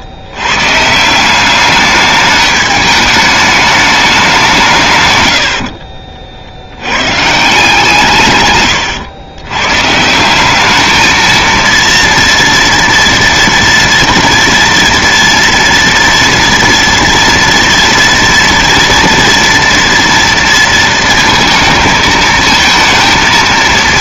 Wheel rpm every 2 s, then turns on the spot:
120, 210, 180, 60, 130, 200, 230, 230, 230, 230, 230, 230.
none